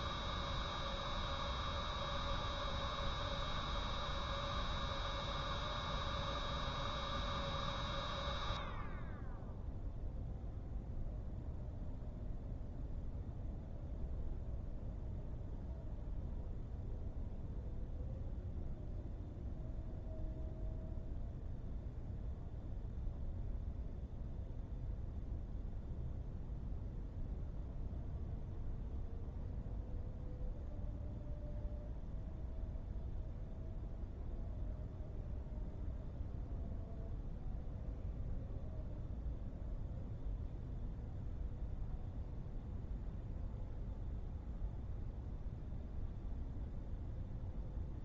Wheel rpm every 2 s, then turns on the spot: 0, 0, 0, 0, 0, 0, 0, 0, 0, 0, 0, 0, 0, 0, 0, 0, 0, 0, 0, 0, 0, 0, 0, 0.
none